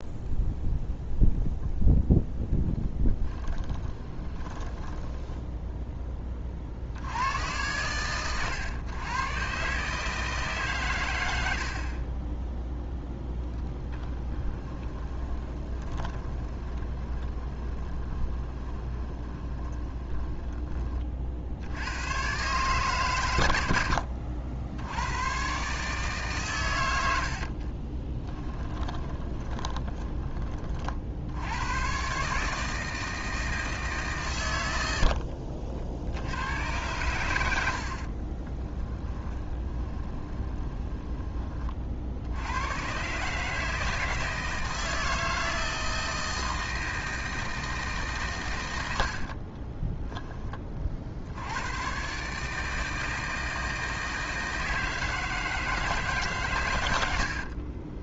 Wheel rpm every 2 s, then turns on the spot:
0, 10, 10, 70, 110, 130, 10, 20, 20, 20, 20, 130, 90, 100, 10, 40, 160, 90, 110, 20, 20, 130, 160, 160, 80, 50, 160, 160, 100.
2-6 14-20 28-30 34-36 38-42